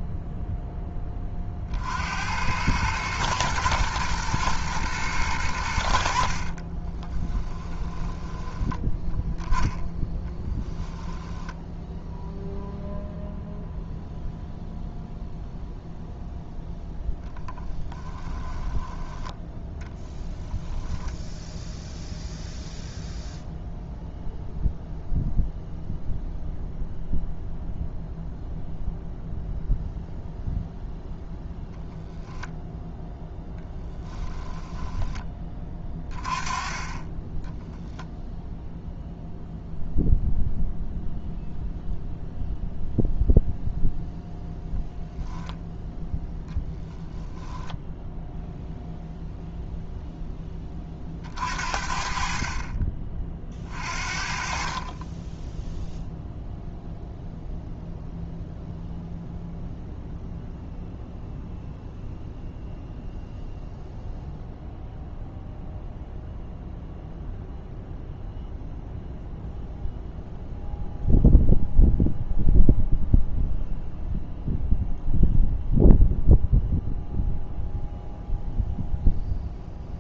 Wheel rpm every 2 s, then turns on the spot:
20, 110, 110, 20, 10, 10, 0, 0, 10, 10, 0, 0, 0, 0, 0, 0, 0, 10, 10, 0, 0, 0, 0, 0, 0, 30, 30, 20, 0, 0, 0, 0, 0, 0, 0, 0, 0, 0, 0, 0.
6-8 10-12 16-20